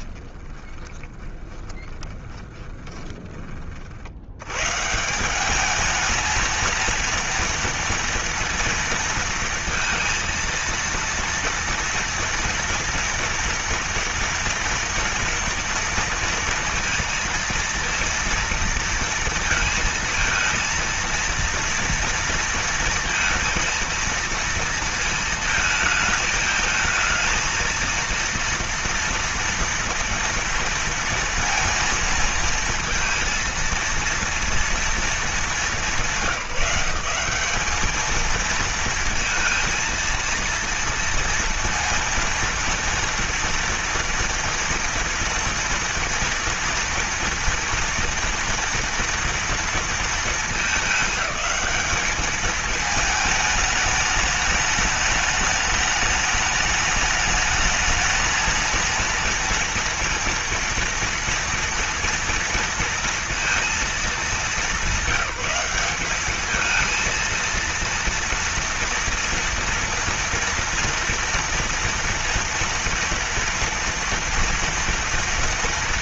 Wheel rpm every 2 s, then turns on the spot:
20, 20, 170, 230, 230, 230, 230, 240, 230, 230, 230, 230, 220, 220, 230, 230, 230, 220, 190, 230, 230, 230, 230, 230, 230, 210, 220, 210, 210, 230, 230, 230, 200, 220, 230, 230, 230, 230.
0-2